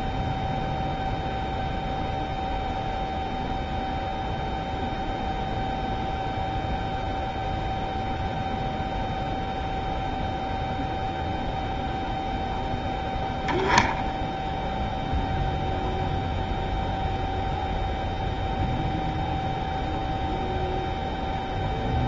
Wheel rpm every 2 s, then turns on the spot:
0, 0, 0, 0, 0, 0, 0, 0, 0, 0, 0.
none